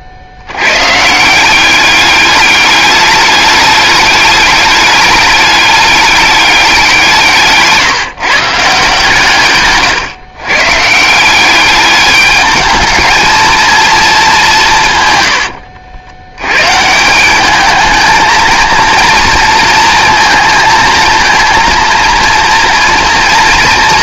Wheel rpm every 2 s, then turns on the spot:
120, 210, 210, 190, 150, 140, 220, 160, 140, 230, 230, 230.
none